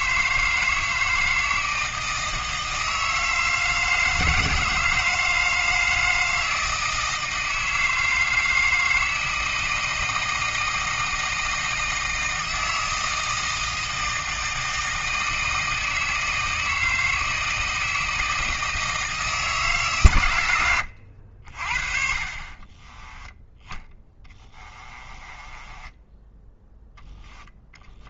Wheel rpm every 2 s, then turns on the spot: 160, 160, 160, 160, 160, 160, 160, 160, 160, 160, 90, 20, 30, 0.
22-26